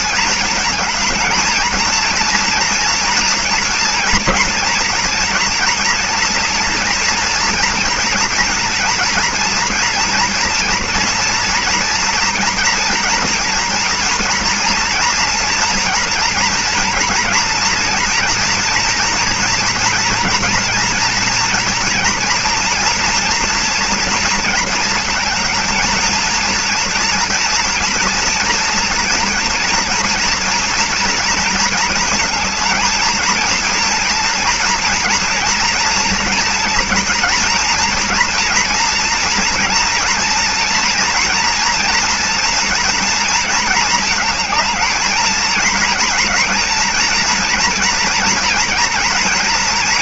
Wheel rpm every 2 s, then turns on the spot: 220, 230, 230, 230, 230, 230, 230, 230, 230, 240, 240, 230, 230, 230, 230, 230, 230, 230, 240, 240, 240, 240, 220, 230, 230.
none